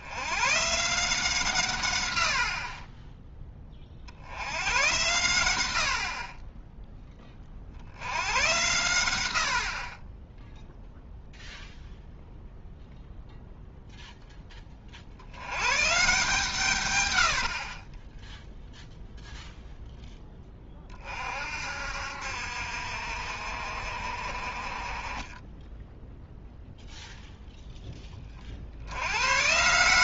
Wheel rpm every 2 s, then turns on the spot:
140, 30, 100, 10, 100, 0, 0, 30, 130, 0, 20, 60, 30, 0, 70.
none